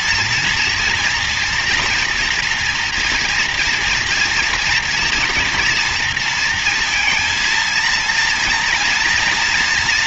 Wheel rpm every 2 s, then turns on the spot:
230, 240, 240, 230, 230.
none